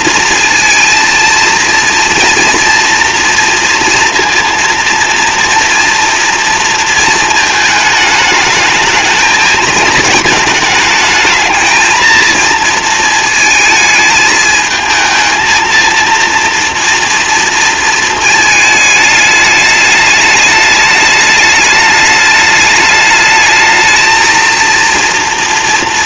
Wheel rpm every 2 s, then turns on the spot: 230, 230, 230, 230, 220, 220, 230, 220, 230, 210, 210, 210, 230.
none